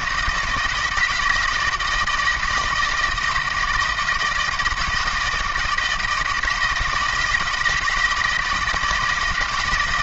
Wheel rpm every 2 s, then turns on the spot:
160, 170, 160, 160, 160.
none